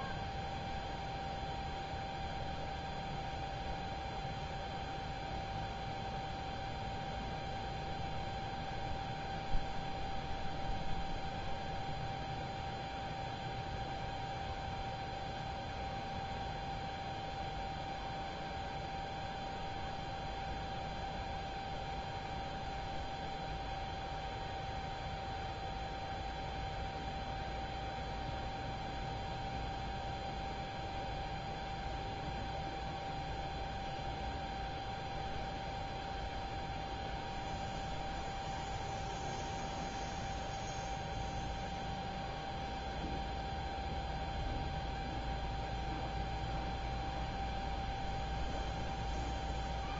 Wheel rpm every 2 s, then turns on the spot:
0, 0, 0, 0, 0, 0, 0, 0, 0, 0, 0, 0, 0, 0, 0, 0, 0, 0, 0, 0, 0, 0, 0, 0, 0.
none